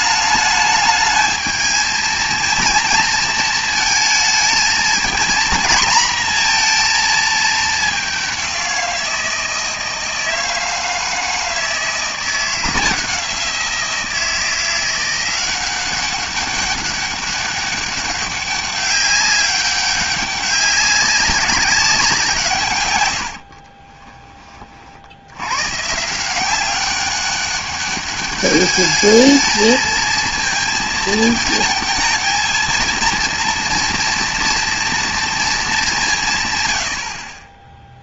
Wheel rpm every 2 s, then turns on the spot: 220, 230, 220, 230, 180, 160, 170, 170, 200, 200, 190, 130, 50, 190, 210, 220, 230, 230, 110.
none